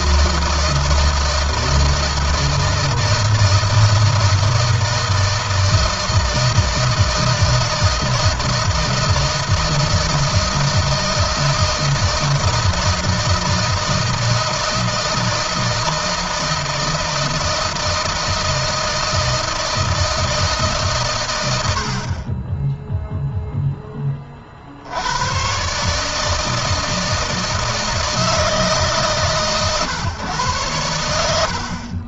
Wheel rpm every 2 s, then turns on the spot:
160, 160, 160, 160, 160, 160, 160, 160, 160, 160, 130, 0, 80, 160, 150, 100.
none